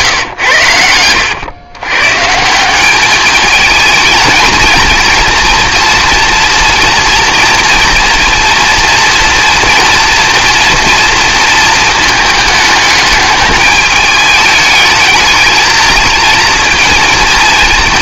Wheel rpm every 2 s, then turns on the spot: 100, 180, 220, 230, 230, 240, 210, 220, 220.
none